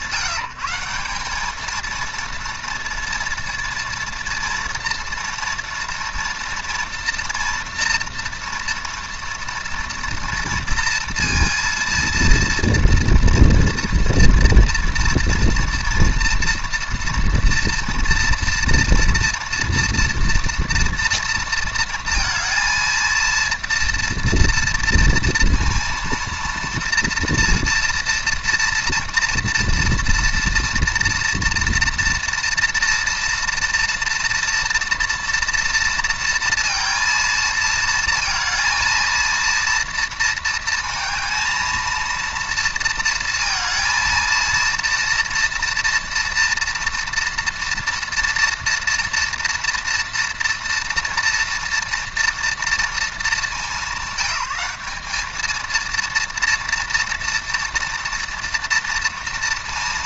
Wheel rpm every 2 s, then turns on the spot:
180, 230, 230, 230, 230, 230, 230, 240, 230, 230, 230, 230, 230, 230, 230, 230, 230, 230, 230, 220, 220, 230, 230, 230, 230, 230, 230, 200, 230, 230.
none